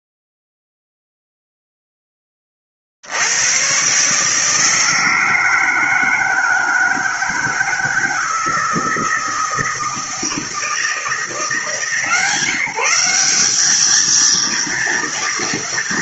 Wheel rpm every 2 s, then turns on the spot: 0, 20, 150, 160, 160, 160, 160, 230.
none